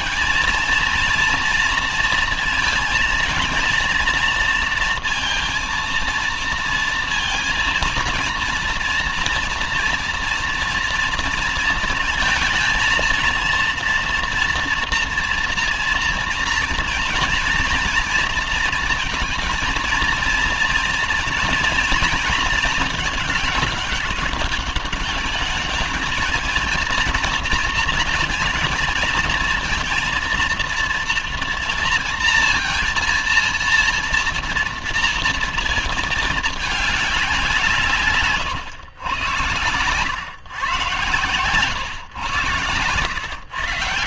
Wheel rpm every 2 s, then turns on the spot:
230, 230, 220, 230, 230, 230, 230, 230, 240, 230, 230, 220, 200, 220, 230, 230, 230, 230, 210, 130, 120, 120.
none